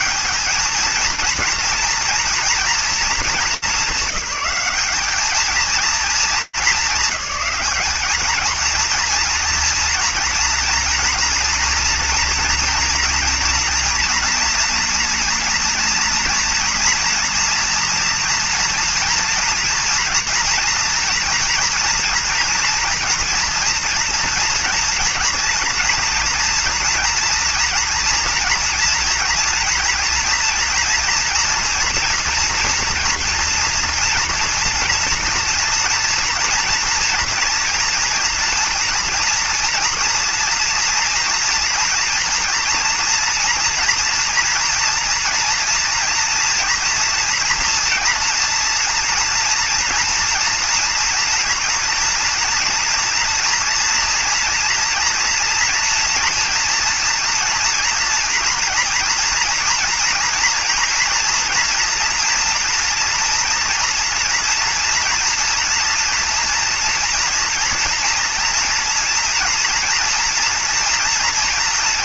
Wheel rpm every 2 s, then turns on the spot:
210, 230, 200, 210, 230, 230, 230, 240, 230, 230, 230, 240, 230, 240, 230, 230, 230, 230, 230, 230, 230, 240, 240, 240, 230, 230, 230, 240, 230, 240, 240, 230, 230, 230, 240, 230.
none